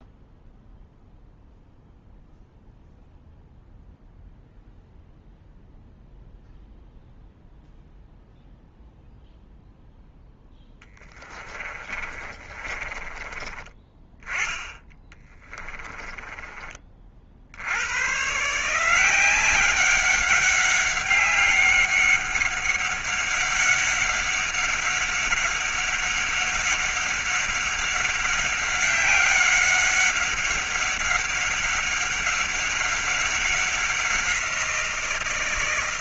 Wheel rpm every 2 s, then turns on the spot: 0, 0, 0, 0, 0, 10, 30, 20, 40, 160, 190, 200, 190, 190, 190, 200, 200, 170.
10-16